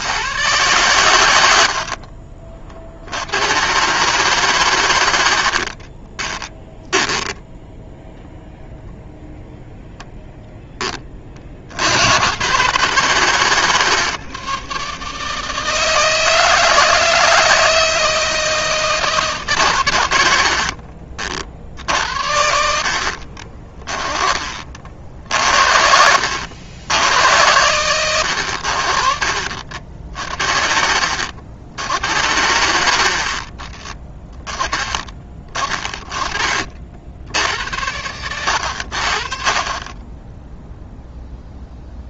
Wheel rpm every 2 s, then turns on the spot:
100, 50, 120, 10, 0, 10, 140, 150, 160, 160, 80, 60, 30, 80, 80, 50, 80, 30, 30, 90, 0.
20-22 32-34